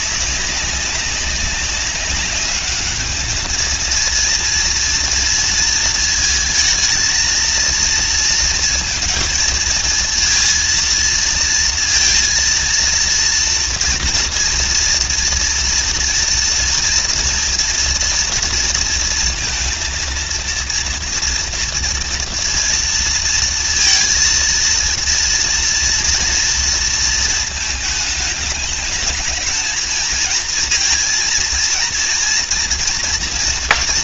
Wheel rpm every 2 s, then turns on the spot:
190, 210, 230, 230, 230, 230, 230, 230, 230, 230, 230, 230, 230, 230, 220, 230, 230.
none